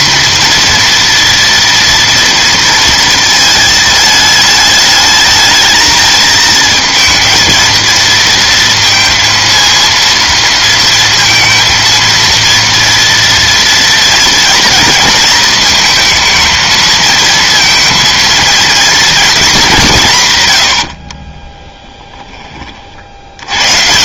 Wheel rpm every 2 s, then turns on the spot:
240, 230, 210, 220, 230, 230, 230, 230, 220, 230, 100, 40.
none